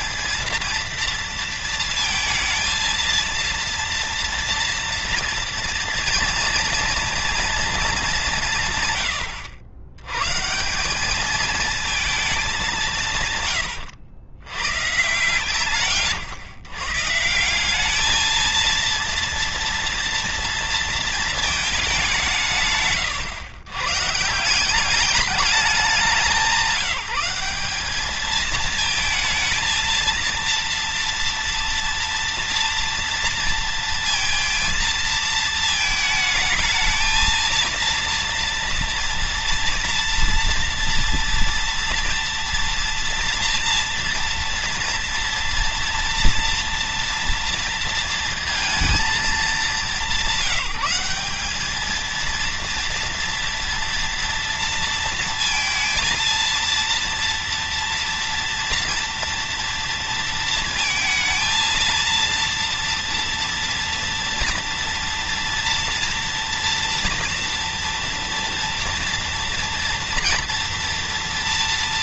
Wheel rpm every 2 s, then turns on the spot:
230, 230, 240, 240, 150, 180, 180, 120, 130, 230, 230, 150, 190, 190, 220, 230, 230, 230, 220, 230, 230, 230, 230, 230, 220, 190, 230, 230, 230, 230, 230, 230, 230, 240, 230, 230.
none